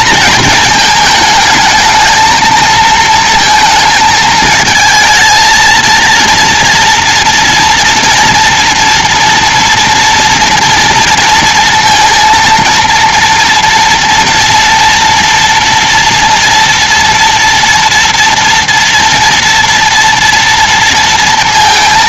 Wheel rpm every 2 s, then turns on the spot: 230, 220, 220, 230, 230, 230, 230, 230, 230, 240, 230.
none